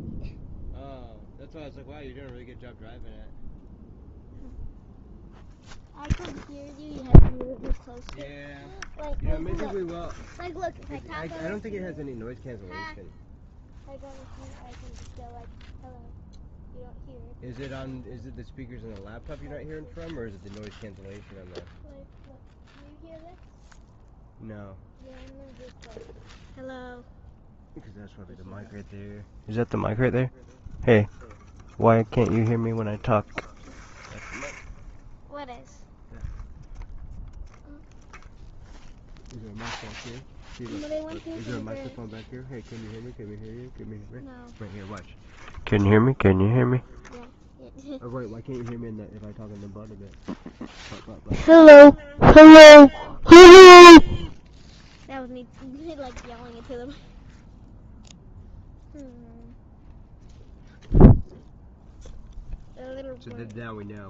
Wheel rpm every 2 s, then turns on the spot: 0, 0, 0, 0, 0, 0, 0, 0, 0, 0, 0, 0, 0, 0, 0, 0, 0, 0, 0, 0, 0, 0, 0, 0, 0, 0, 0, 0, 0, 0, 0, 0.
none